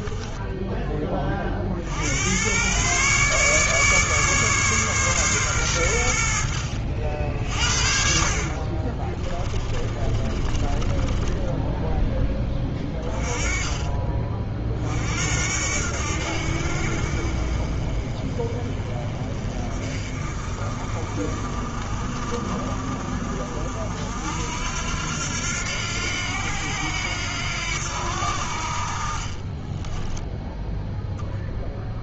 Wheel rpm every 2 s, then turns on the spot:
10, 110, 140, 70, 40, 30, 20, 40, 60, 30, 40, 50, 80, 90, 50, 0.
8-14